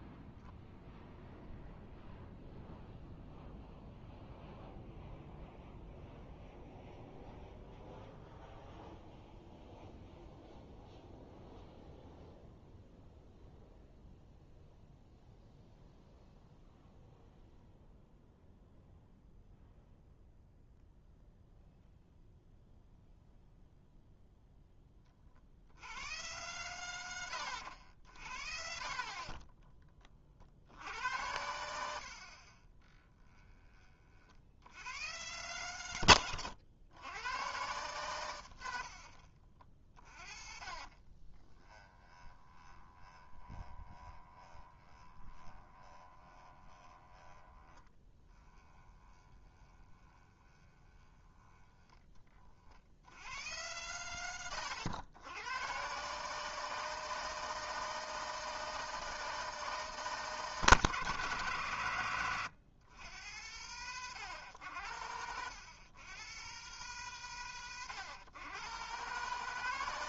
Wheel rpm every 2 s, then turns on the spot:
0, 0, 0, 0, 0, 0, 0, 0, 0, 0, 0, 0, 10, 110, 50, 60, 30, 70, 100, 80, 40, 20, 20, 20, 20, 20, 50, 90, 160, 160, 160, 110, 90, 130, 120.
28-30 40-52